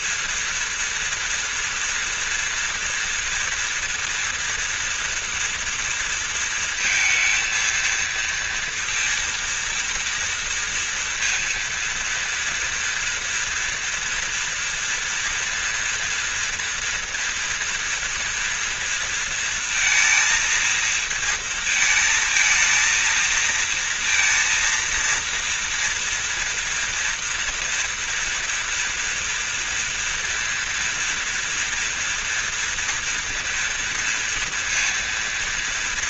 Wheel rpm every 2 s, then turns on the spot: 230, 230, 240, 230, 230, 230, 230, 240, 230, 230, 230, 230, 230, 230, 230, 230, 230, 230.
none